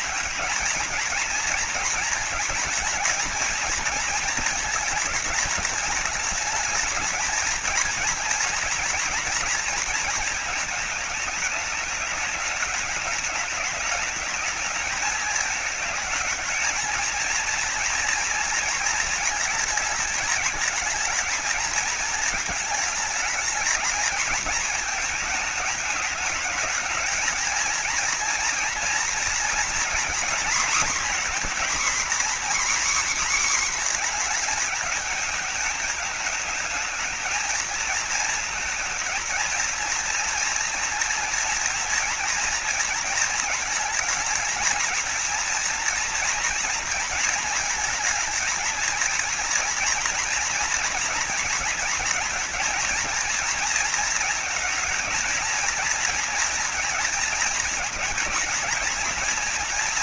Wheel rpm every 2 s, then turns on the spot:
220, 230, 220, 220, 230, 220, 210, 210, 230, 230, 220, 210, 210, 220, 230, 250, 260, 220, 220, 230, 240, 230, 230, 230, 220, 240, 230, 230, 220, 230.
none